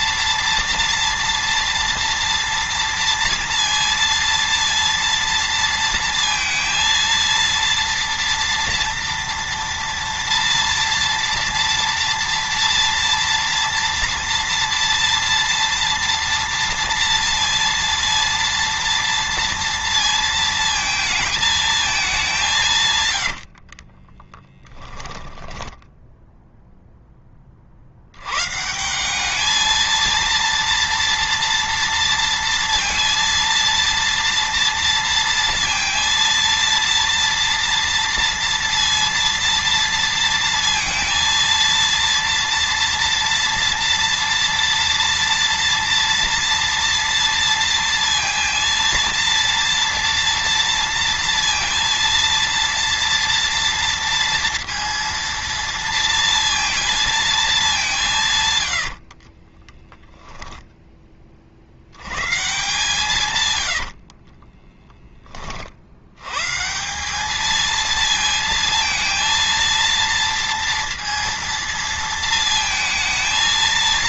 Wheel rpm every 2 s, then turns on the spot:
230, 230, 230, 230, 230, 230, 230, 230, 230, 230, 220, 150, 10, 0, 160, 230, 230, 230, 230, 230, 230, 230, 230, 230, 230, 230, 230, 230, 230, 90, 10, 150, 10, 170, 230, 230, 220.
22-26 58-60